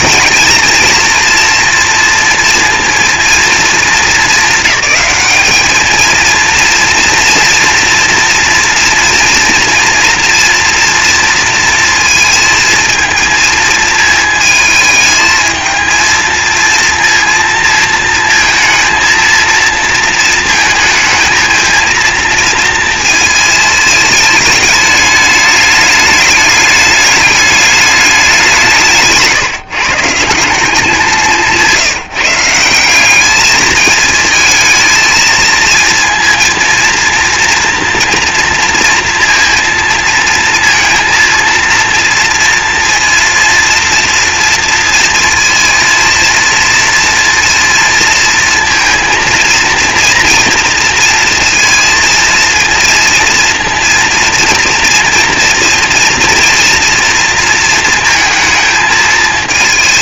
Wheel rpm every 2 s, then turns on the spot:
220, 230, 210, 230, 230, 230, 220, 220, 230, 230, 230, 230, 210, 210, 180, 190, 180, 220, 230, 230, 230, 230, 230, 230, 230, 240, 230, 230, 230, 220.
none